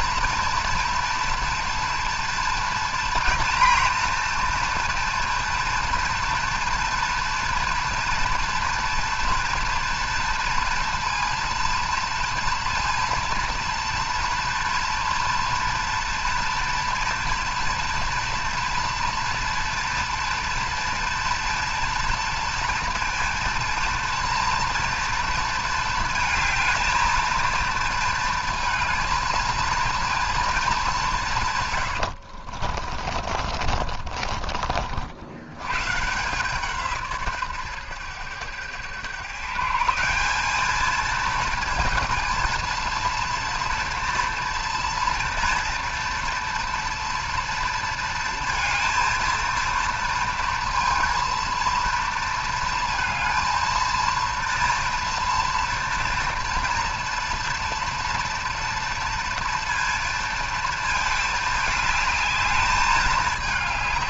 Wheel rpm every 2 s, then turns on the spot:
230, 230, 230, 230, 230, 230, 230, 230, 240, 230, 230, 230, 230, 220, 230, 210, 50, 50, 160, 110, 220, 230, 230, 230, 230, 230, 230, 240, 230, 230, 230, 210.
32-34